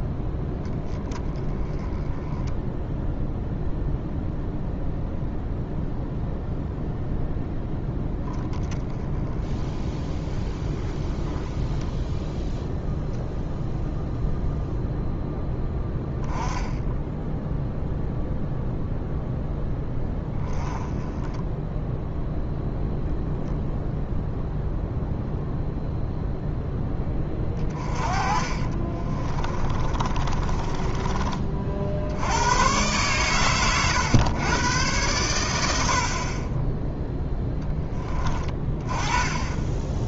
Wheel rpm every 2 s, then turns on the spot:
10, 0, 0, 0, 10, 10, 0, 0, 10, 0, 10, 0, 0, 10, 30, 30, 120, 110, 10, 20.
28-32